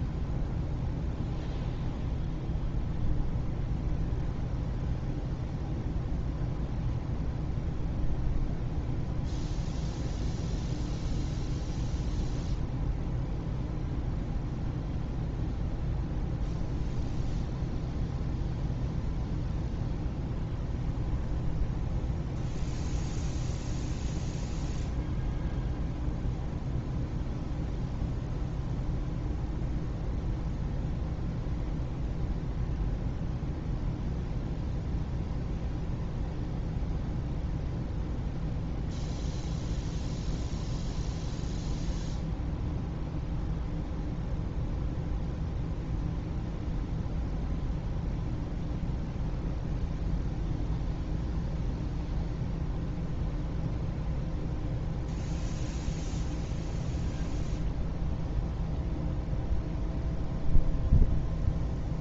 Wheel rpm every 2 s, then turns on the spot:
0, 0, 0, 0, 0, 0, 0, 0, 0, 0, 0, 0, 0, 0, 0, 0, 0, 0, 0, 0, 0, 0, 0, 0, 0, 0, 0, 0, 0, 0, 0.
none